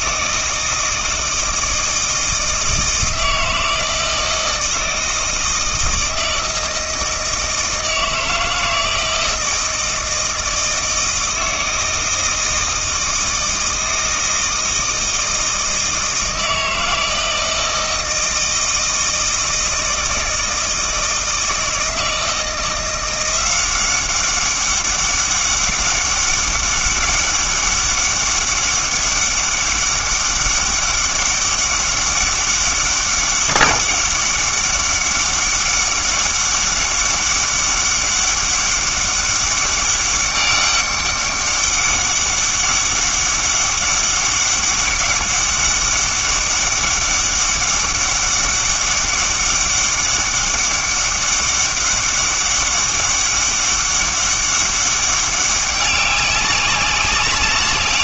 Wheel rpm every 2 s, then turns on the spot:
160, 160, 160, 160, 160, 160, 160, 160, 160, 160, 160, 170, 200, 200, 200, 200, 200, 200, 200, 200, 200, 200, 200, 200, 200, 200, 200, 200, 190.
none